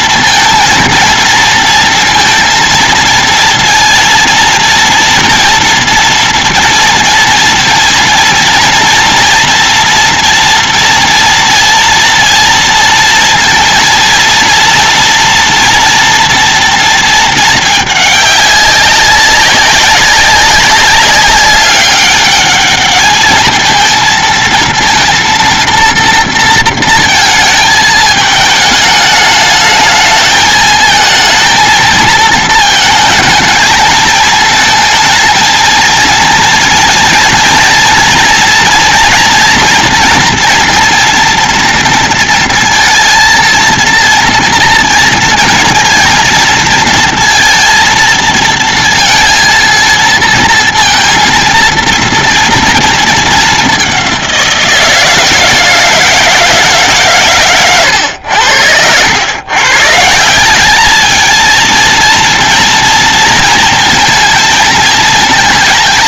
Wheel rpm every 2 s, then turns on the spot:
230, 230, 230, 230, 230, 230, 230, 230, 230, 210, 200, 200, 230, 230, 210, 220, 220, 220, 230, 240, 230, 230, 230, 230, 230, 230, 230, 190, 160, 100, 160, 230, 230.
none